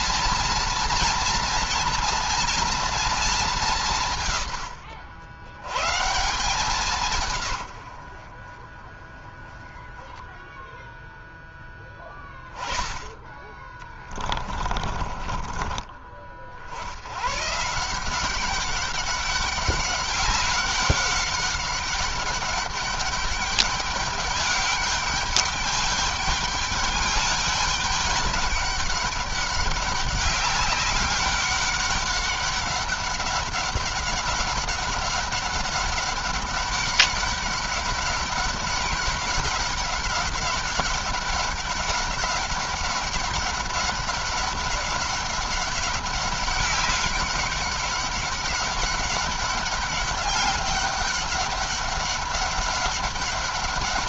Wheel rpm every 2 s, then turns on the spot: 230, 230, 90, 160, 20, 0, 10, 30, 90, 200, 190, 200, 200, 210, 200, 190, 190, 200, 200, 200, 190, 200, 200, 200, 200, 200, 200.
14-16